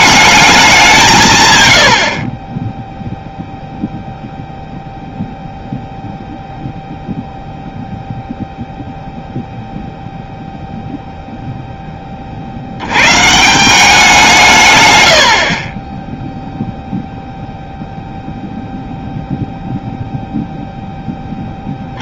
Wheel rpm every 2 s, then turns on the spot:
190, 10, 0, 0, 0, 0, 70, 140, 0, 0, 0.
none